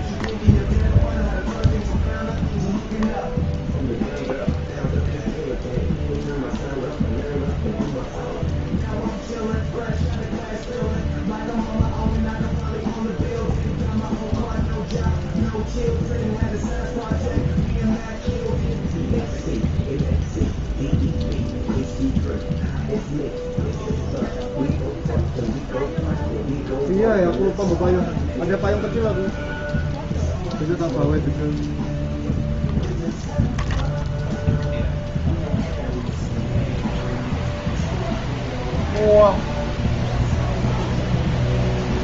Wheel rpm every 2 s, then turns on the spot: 0, 0, 0, 0, 0, 0, 0, 0, 0, 0, 0, 0, 0, 0, 0, 0, 0, 0, 0, 0, 0.
none